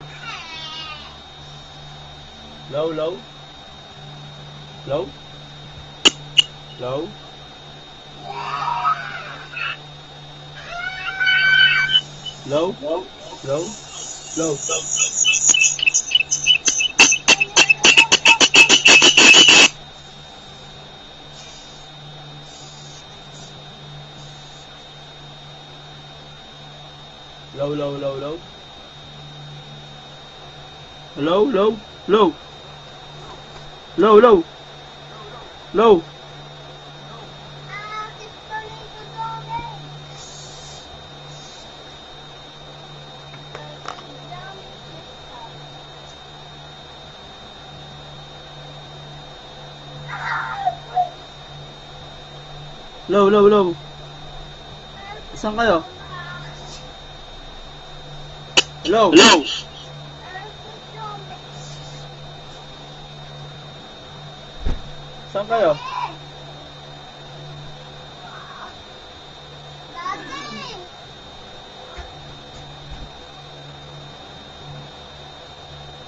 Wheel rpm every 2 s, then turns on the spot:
0, 0, 0, 0, 0, 0, 0, 0, 0, 0, 0, 0, 0, 0, 0, 0, 0, 0, 0, 0, 0, 0, 0, 0, 0, 0, 0, 0, 0, 0, 0, 0, 0, 0, 0, 0, 0, 0.
none